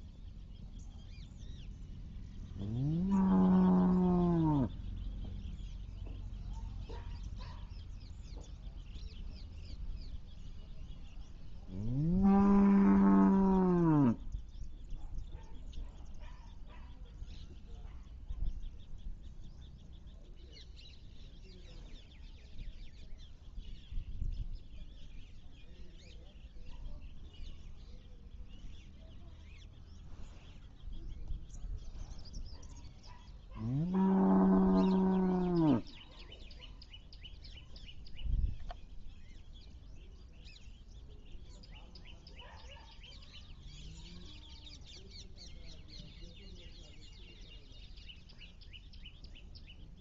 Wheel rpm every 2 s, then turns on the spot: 0, 0, 0, 0, 0, 0, 0, 0, 0, 0, 0, 0, 0, 0, 0, 0, 0, 0, 0, 0, 0, 0, 0, 0, 0.
none